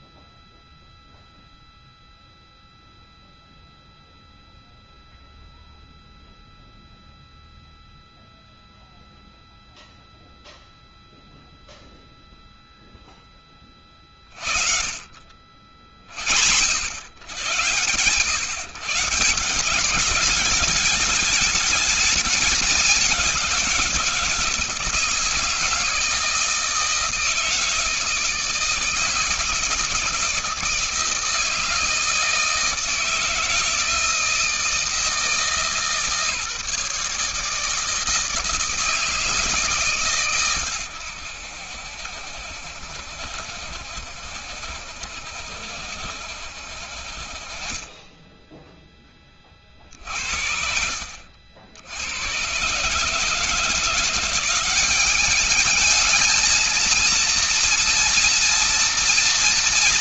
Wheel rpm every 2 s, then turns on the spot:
0, 0, 0, 0, 0, 0, 0, 40, 80, 130, 210, 200, 170, 160, 160, 170, 160, 160, 150, 160, 110, 70, 70, 60, 10, 60, 130, 190, 230, 230.
none